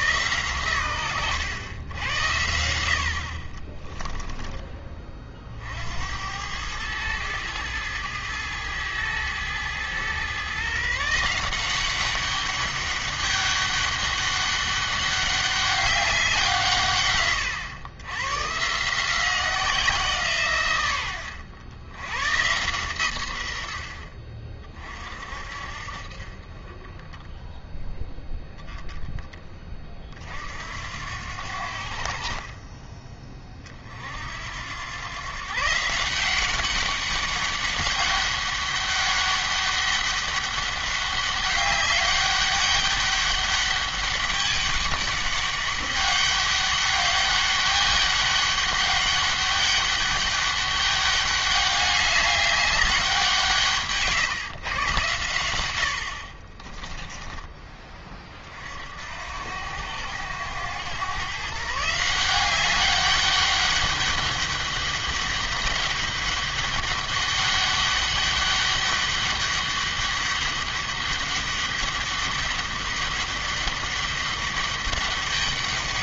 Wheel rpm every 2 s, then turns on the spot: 110, 80, 20, 100, 110, 140, 200, 200, 150, 150, 110, 130, 40, 20, 0, 70, 30, 90, 190, 200, 200, 200, 200, 200, 200, 200, 200, 120, 20, 50, 110, 200, 200, 200, 200, 200, 200, 200.
56-58